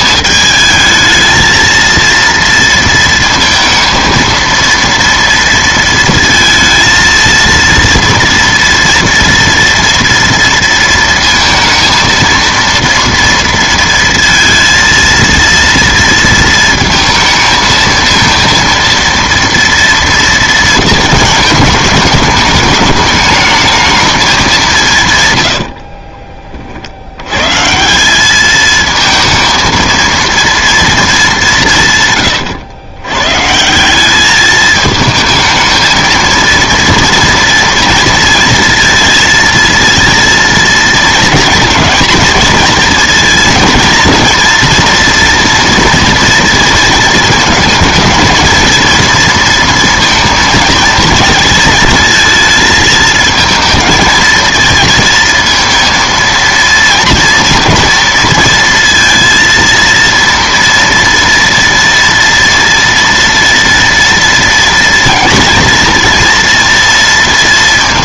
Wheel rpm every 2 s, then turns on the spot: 220, 230, 230, 230, 240, 230, 230, 230, 220, 230, 220, 220, 160, 60, 220, 230, 110, 220, 230, 230, 220, 230, 230, 230, 230, 230, 220, 230, 230, 230, 230, 230, 230, 230.
none